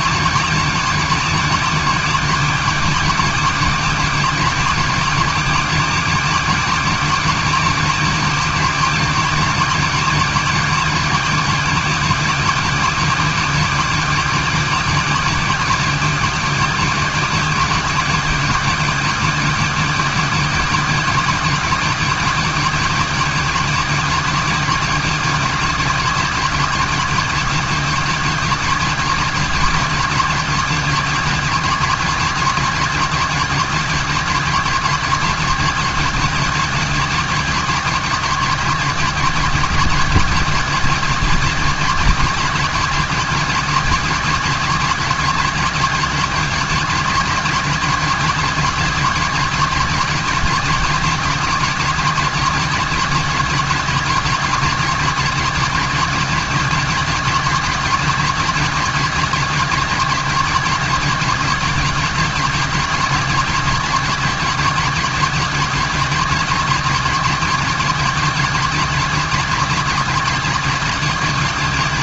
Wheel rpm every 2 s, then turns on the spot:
270, 270, 270, 270, 270, 270, 260, 260, 260, 260, 260, 270, 270, 270, 260, 260, 260, 270, 260, 270, 270, 270, 260, 260, 270, 260, 260, 270, 260, 260, 260, 260, 260, 260, 260, 270.
none